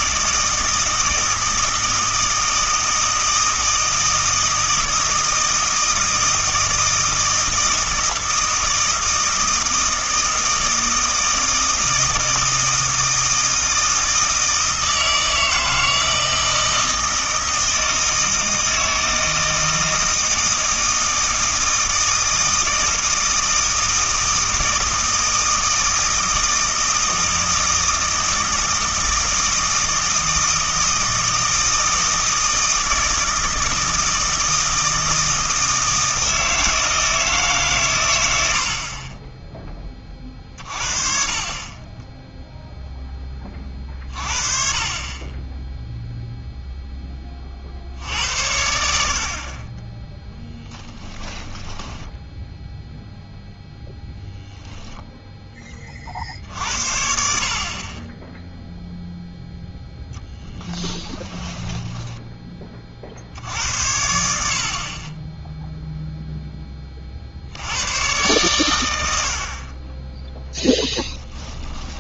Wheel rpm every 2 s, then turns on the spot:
160, 160, 160, 160, 160, 160, 160, 160, 160, 160, 160, 160, 160, 160, 160, 160, 160, 160, 160, 60, 40, 0, 40, 0, 70, 10, 0, 0, 60, 0, 10, 30, 60, 10, 120, 0.
50-52 60-62